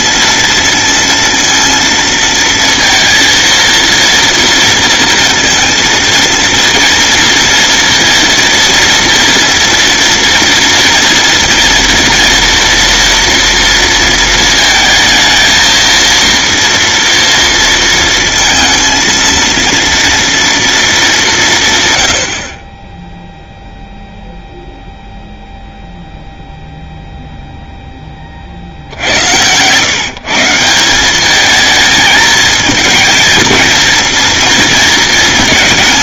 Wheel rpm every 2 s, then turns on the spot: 230, 230, 230, 230, 230, 230, 230, 220, 230, 230, 190, 0, 0, 0, 80, 200, 220, 230.
28-30